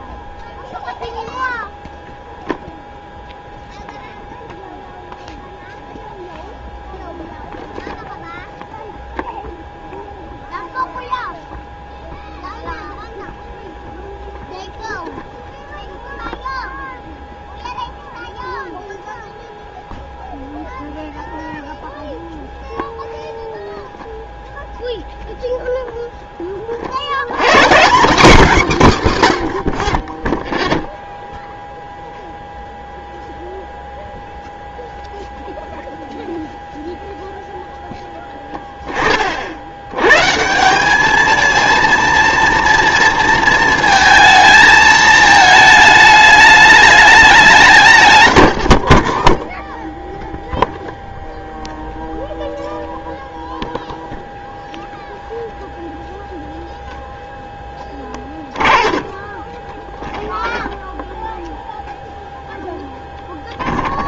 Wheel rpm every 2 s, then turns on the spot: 0, 0, 0, 0, 0, 0, 0, 0, 0, 0, 0, 0, 0, 30, 230, 0, 0, 0, 0, 10, 170, 230, 220, 210, 70, 0, 0, 0, 0, 20, 10, 0.
48-50